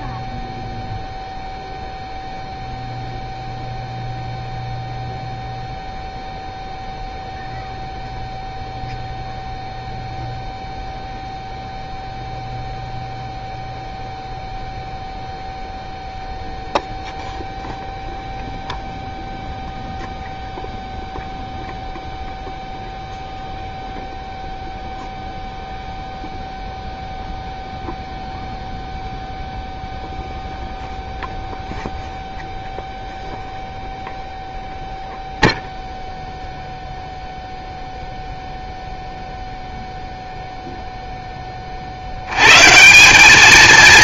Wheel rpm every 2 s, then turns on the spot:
0, 0, 0, 0, 0, 0, 0, 0, 0, 0, 0, 0, 0, 0, 0, 0, 0, 0, 0, 0, 0, 140.
none